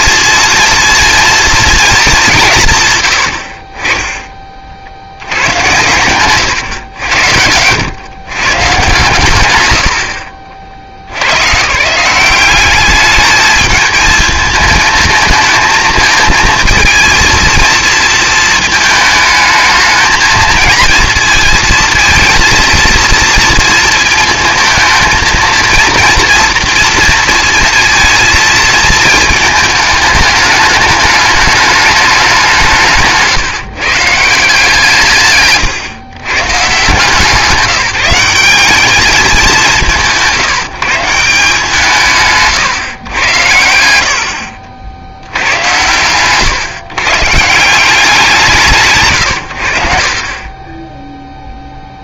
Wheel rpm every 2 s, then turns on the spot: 230, 130, 60, 110, 140, 60, 200, 220, 230, 220, 230, 220, 220, 230, 220, 210, 170, 160, 140, 200, 160, 140, 70, 140, 150, 20.
44-46 50-52